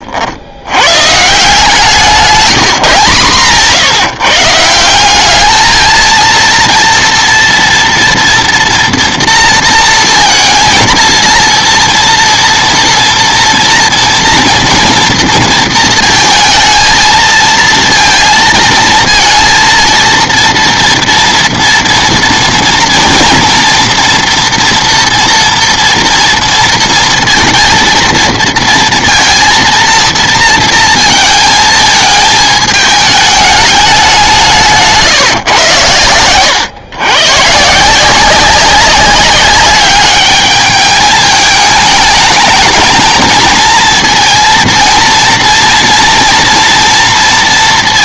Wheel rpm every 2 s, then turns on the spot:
110, 160, 180, 230, 230, 230, 230, 230, 220, 230, 230, 230, 240, 230, 230, 230, 220, 160, 120, 190, 210, 220, 230, 230.
34-36